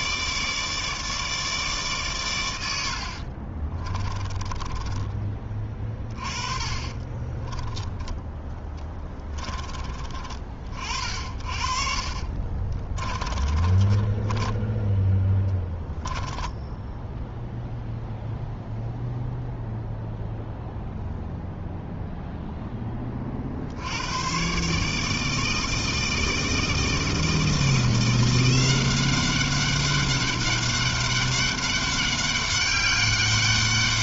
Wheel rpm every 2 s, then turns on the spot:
160, 50, 20, 20, 20, 60, 20, 0, 0, 0, 0, 40, 160, 160, 190, 200, 200.
2-14